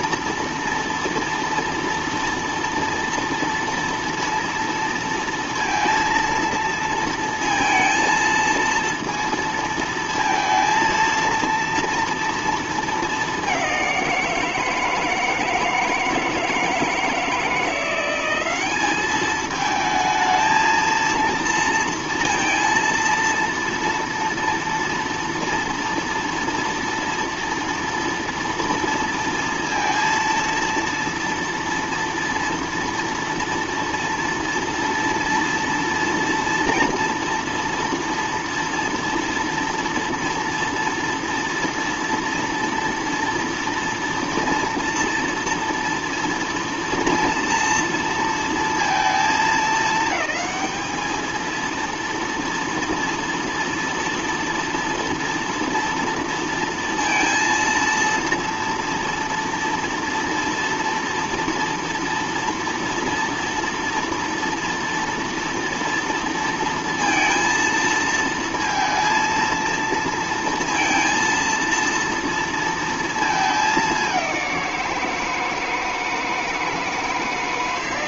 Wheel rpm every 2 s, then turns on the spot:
230, 230, 230, 230, 230, 230, 220, 160, 160, 200, 230, 230, 240, 230, 230, 230, 230, 230, 230, 230, 230, 230, 230, 230, 220, 220, 230, 230, 230, 230, 230, 230, 230, 230, 230, 230, 230, 180, 160.
none